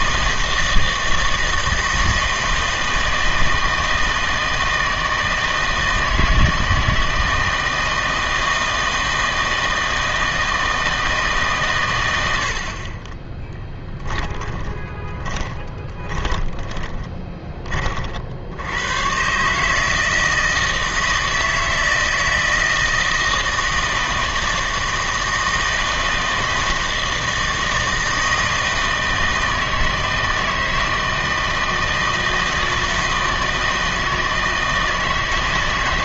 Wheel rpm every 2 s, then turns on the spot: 160, 160, 160, 160, 160, 160, 50, 20, 20, 100, 160, 160, 160, 160, 160, 160, 160, 160.
14-18